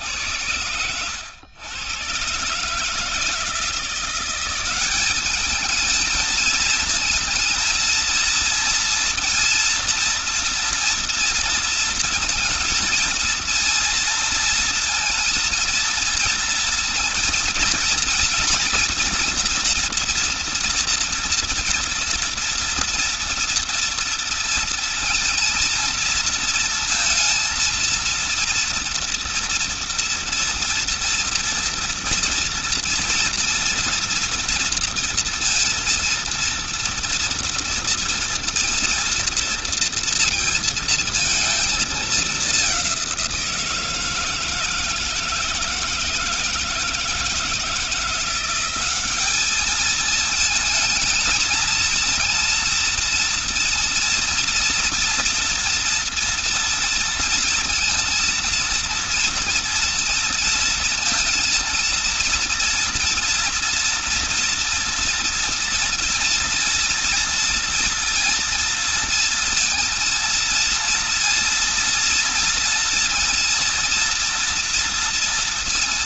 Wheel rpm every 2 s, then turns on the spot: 100, 140, 190, 220, 230, 230, 230, 230, 230, 230, 230, 230, 230, 230, 230, 240, 230, 230, 230, 230, 230, 200, 160, 160, 180, 220, 230, 230, 230, 230, 230, 230, 230, 230, 230, 230, 230, 230.
none